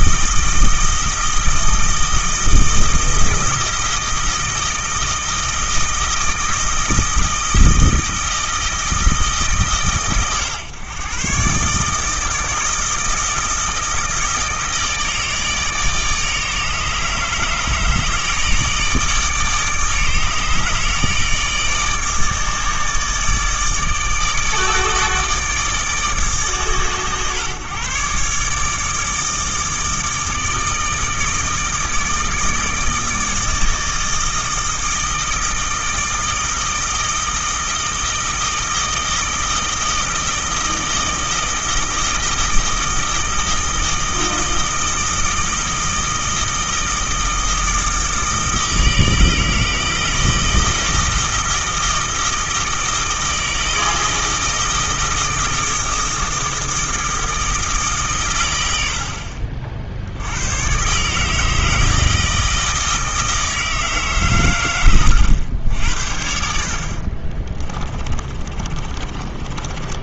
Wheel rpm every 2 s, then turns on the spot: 160, 160, 160, 160, 160, 130, 160, 160, 150, 160, 150, 160, 150, 140, 150, 160, 160, 160, 160, 160, 160, 160, 160, 160, 160, 160, 160, 160, 160, 100, 110, 160, 110, 60, 30.
66-70